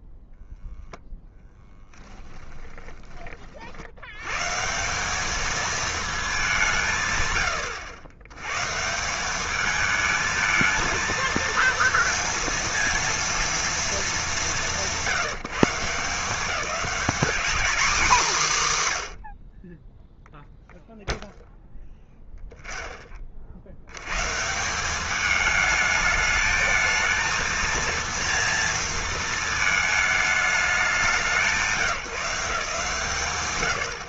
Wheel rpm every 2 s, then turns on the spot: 0, 10, 160, 180, 140, 230, 230, 130, 200, 190, 0, 0, 170, 220, 230, 210, 180.
2-4